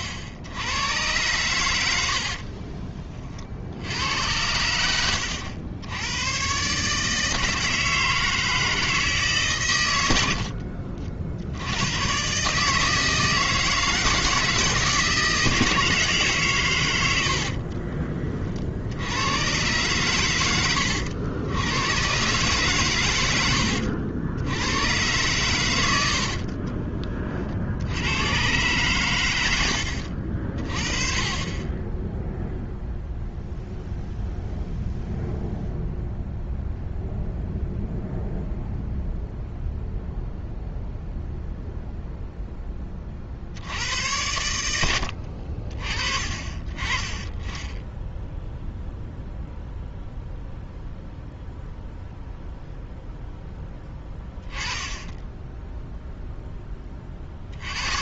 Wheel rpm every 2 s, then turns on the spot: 80, 20, 90, 130, 160, 60, 140, 160, 130, 50, 90, 120, 100, 40, 120, 40, 0, 0, 0, 0, 0, 10, 90, 30, 0, 0, 0, 10, 10.
2-4 10-12 26-28 44-46 54-56